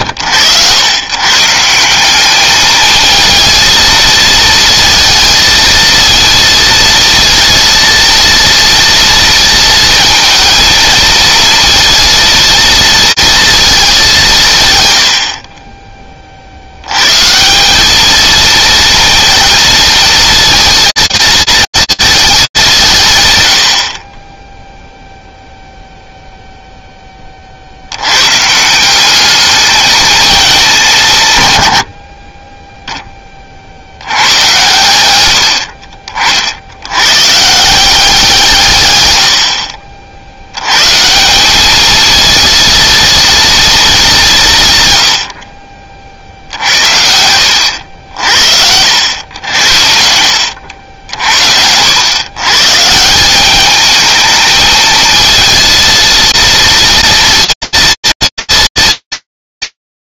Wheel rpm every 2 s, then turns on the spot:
110, 220, 230, 230, 230, 230, 230, 120, 80, 230, 230, 190, 0, 0, 160, 190, 20, 100, 100, 110, 140, 230, 110, 70, 80, 70, 160, 220, 230, 230.
none